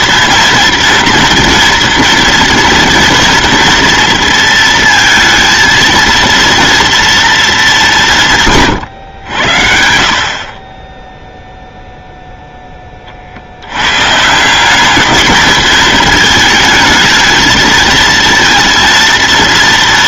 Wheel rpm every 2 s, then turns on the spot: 230, 230, 230, 230, 130, 30, 10, 200, 220, 230.
none